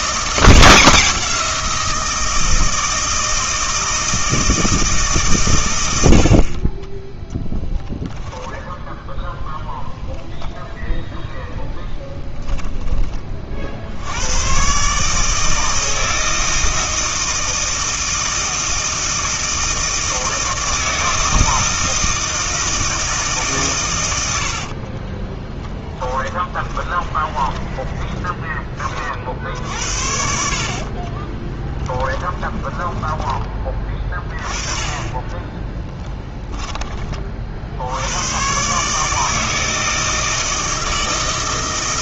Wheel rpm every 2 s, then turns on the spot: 170, 160, 160, 30, 10, 0, 10, 130, 160, 160, 160, 160, 60, 10, 20, 60, 20, 20, 10, 140, 160.
8-10 24-28 32-34